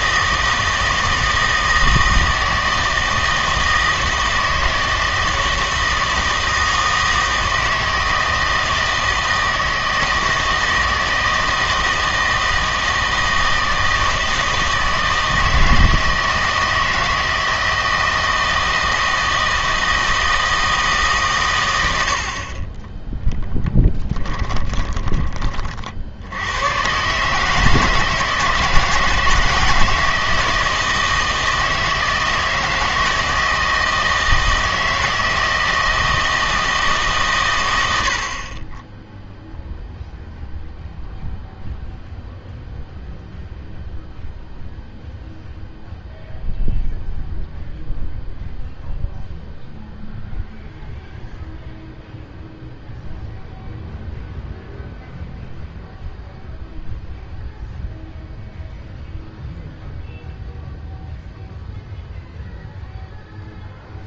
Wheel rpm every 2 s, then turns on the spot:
160, 160, 160, 160, 160, 160, 160, 160, 160, 160, 160, 20, 20, 110, 160, 160, 160, 160, 160, 20, 0, 0, 0, 0, 0, 0, 0, 0, 0, 0, 0, 0.
24-26